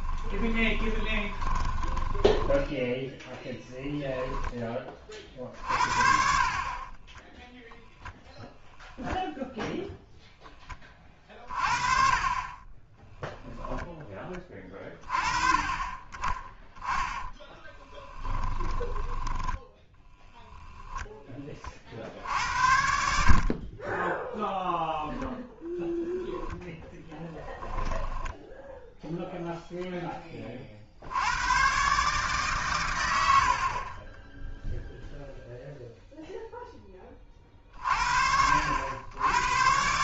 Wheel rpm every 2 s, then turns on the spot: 20, 10, 30, 20, 0, 20, 20, 30, 10, 10, 0, 70, 0, 10, 0, 60, 120, 0, 20, 80.
0-4 6-8 18-20 26-28